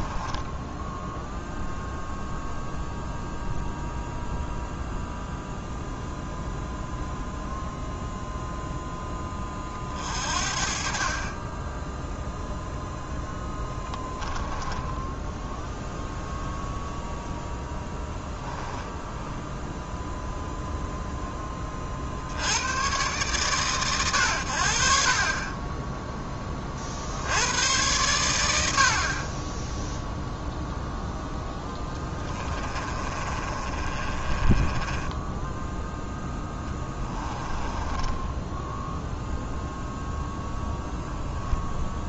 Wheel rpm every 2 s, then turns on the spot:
0, 0, 0, 0, 0, 40, 0, 10, 0, 10, 0, 110, 80, 60, 40, 0, 30, 10, 10, 0, 0.
14-16 18-20 32-38